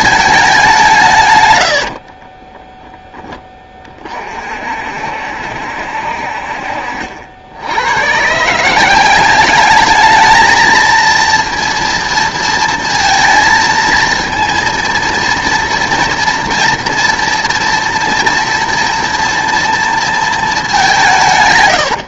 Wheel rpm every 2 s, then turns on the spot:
200, 10, 60, 50, 170, 220, 230, 230, 230, 230, 210.
2-4